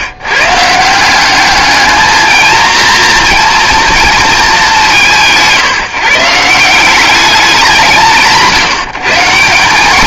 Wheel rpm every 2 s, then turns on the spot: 160, 230, 200, 180, 160.
none